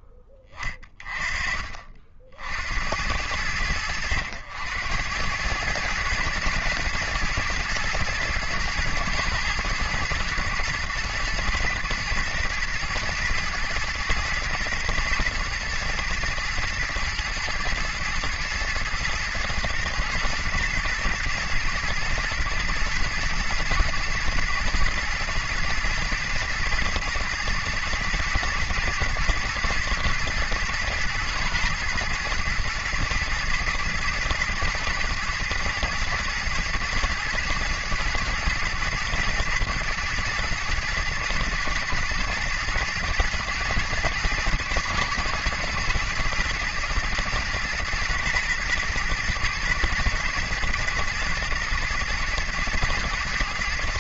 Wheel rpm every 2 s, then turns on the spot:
10, 70, 80, 110, 110, 110, 120, 110, 120, 120, 110, 110, 110, 110, 120, 120, 110, 110, 120, 110, 110, 110, 120, 120, 120, 120, 120.
none